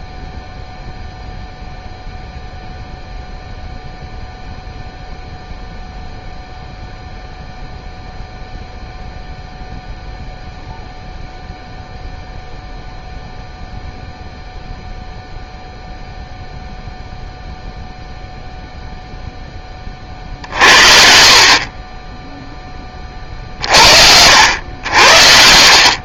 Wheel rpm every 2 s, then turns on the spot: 0, 0, 0, 0, 0, 0, 0, 0, 0, 0, 50, 30, 60.
none